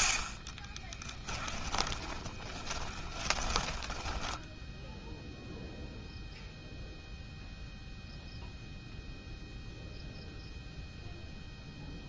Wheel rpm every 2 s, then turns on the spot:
20, 30, 10, 0, 0, 0.
0-6